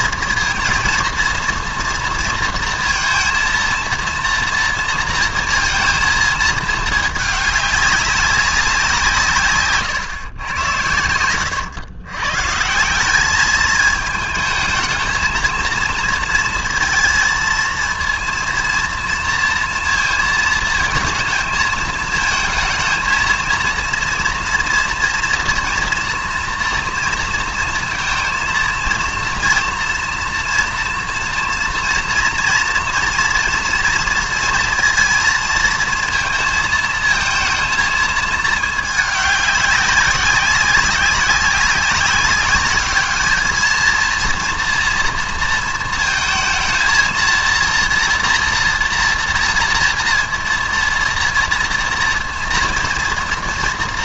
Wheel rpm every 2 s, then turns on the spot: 230, 230, 230, 220, 190, 110, 150, 220, 230, 230, 230, 220, 230, 230, 230, 230, 230, 230, 220, 220, 190, 200, 230, 230, 240, 230, 230.
none